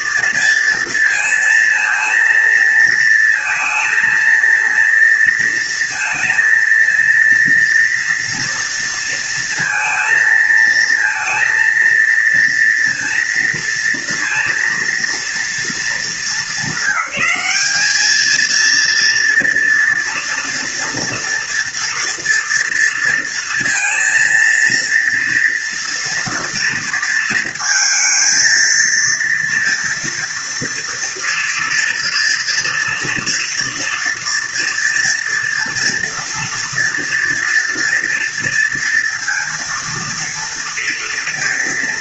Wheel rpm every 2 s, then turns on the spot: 230, 230, 230, 230, 230, 230, 230, 230, 210, 230, 230, 230, 230, 230, 220, 230, 230, 240, 230, 230, 230.
none